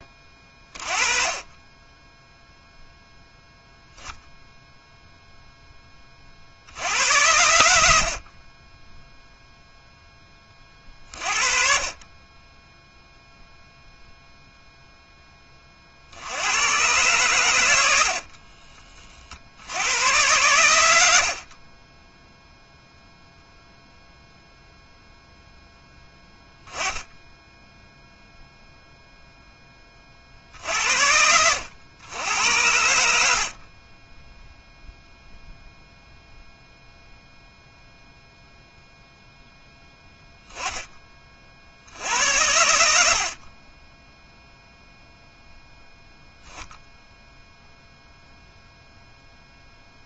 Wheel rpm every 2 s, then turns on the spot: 30, 0, 0, 90, 10, 40, 0, 0, 120, 30, 90, 0, 0, 10, 0, 80, 80, 0, 0, 0, 10, 70, 0, 10, 0.
42-44